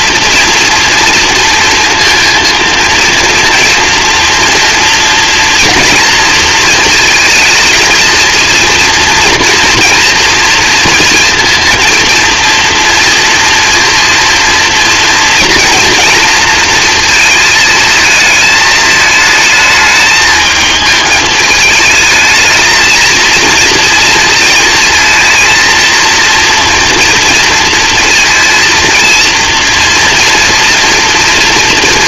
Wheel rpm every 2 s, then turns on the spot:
230, 230, 230, 230, 230, 230, 230, 230, 220, 220, 220, 230, 230, 230, 230, 230.
none